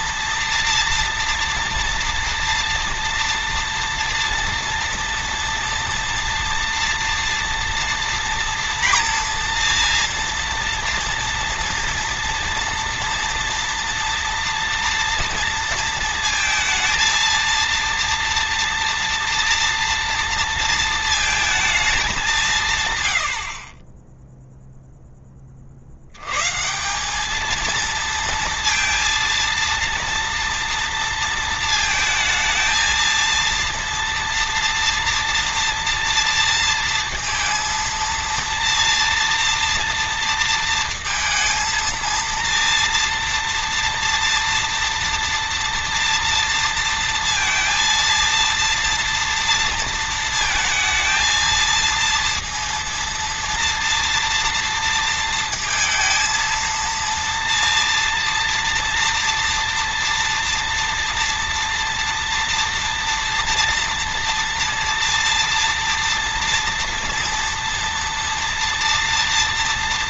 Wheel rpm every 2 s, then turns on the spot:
230, 230, 230, 230, 230, 230, 230, 230, 230, 230, 230, 150, 10, 190, 230, 230, 230, 230, 230, 230, 230, 230, 240, 230, 230, 220, 230, 230, 230, 230, 230, 230, 230, 230, 230.
none